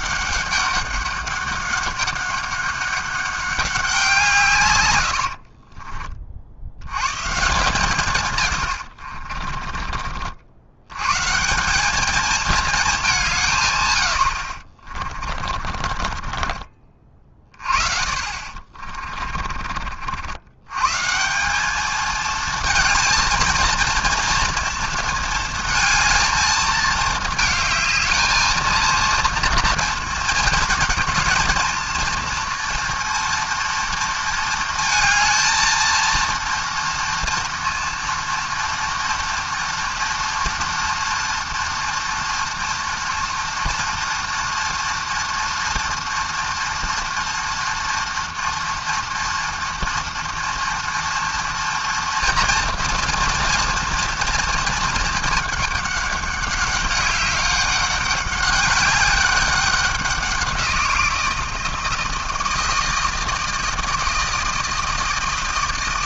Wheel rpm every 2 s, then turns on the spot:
200, 200, 70, 140, 60, 140, 180, 30, 40, 30, 180, 230, 220, 220, 230, 220, 230, 230, 230, 230, 230, 230, 240, 230, 230, 240, 230, 220, 200, 200, 170, 160, 160.
4-6 8-10 14-16 18-20